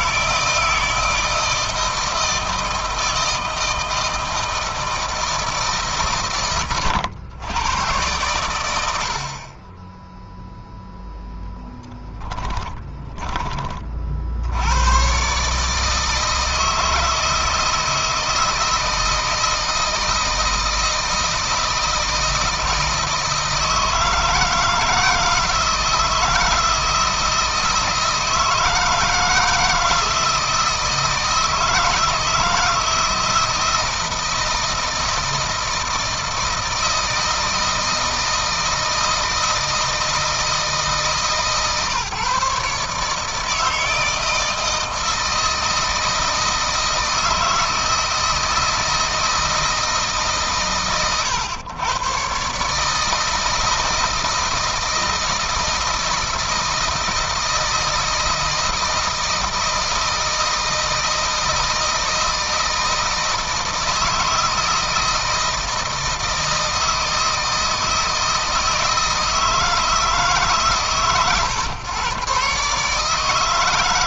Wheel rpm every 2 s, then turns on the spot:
160, 160, 160, 120, 90, 0, 10, 90, 160, 160, 160, 160, 160, 160, 160, 160, 160, 160, 160, 170, 160, 150, 160, 160, 160, 120, 140, 160, 160, 160, 160, 160, 160, 160, 160, 140, 140.
12-14